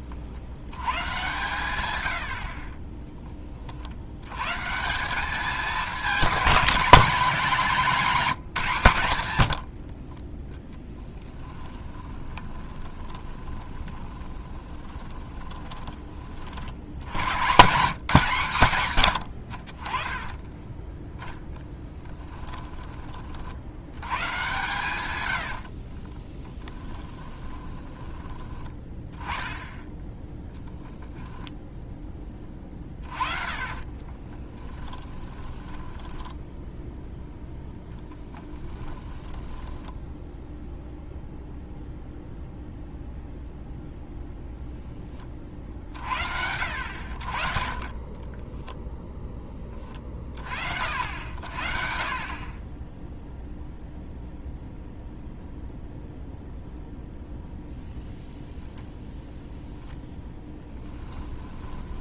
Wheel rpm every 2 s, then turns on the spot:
110, 30, 180, 210, 160, 10, 20, 30, 80, 130, 20, 20, 120, 10, 10, 0, 30, 20, 10, 10, 0, 0, 10, 70, 0, 60, 10, 0, 0, 0, 10.
2-4 10-16 20-22 26-28 32-40